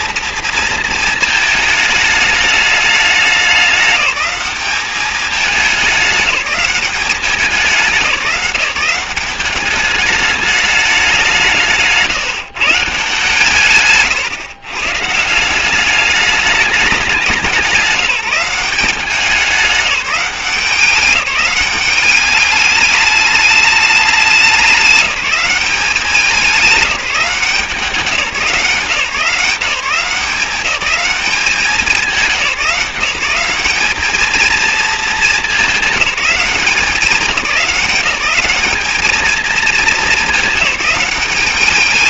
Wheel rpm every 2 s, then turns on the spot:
220, 210, 200, 200, 180, 210, 160, 130, 210, 190, 190, 210, 190, 190, 170, 180, 180, 230, 200, 200, 210.
none